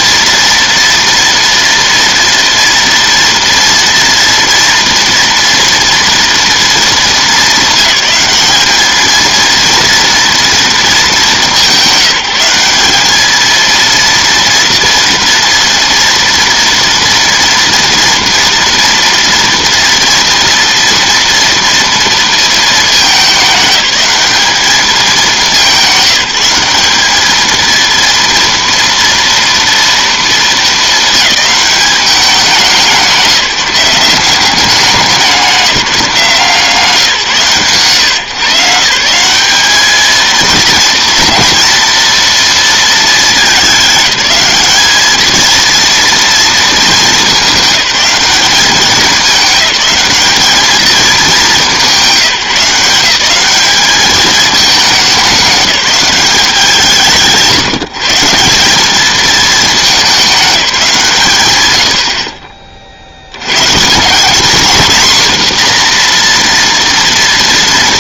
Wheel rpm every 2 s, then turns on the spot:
230, 230, 240, 220, 210, 220, 200, 230, 230, 230, 230, 220, 210, 200, 230, 220, 180, 190, 160, 160, 230, 230, 210, 220, 200, 220, 150, 210, 160, 190, 180, 40, 230, 240.
none